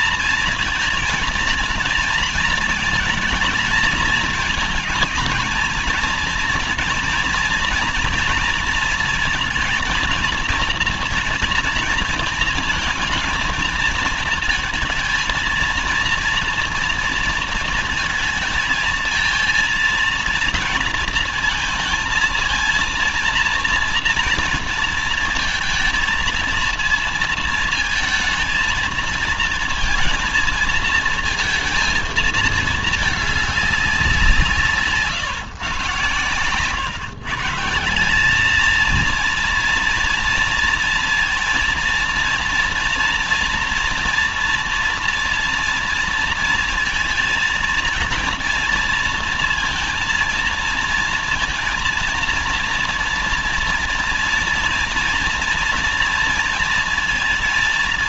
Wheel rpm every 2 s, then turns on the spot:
230, 230, 220, 230, 220, 230, 220, 220, 230, 220, 230, 230, 230, 220, 230, 230, 220, 170, 120, 210, 230, 230, 240, 230, 230, 230, 230, 230, 230.
none